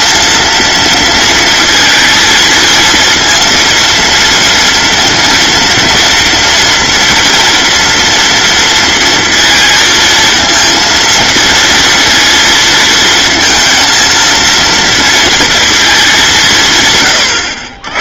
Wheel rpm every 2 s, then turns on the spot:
230, 230, 230, 230, 230, 230, 230, 230, 130.
none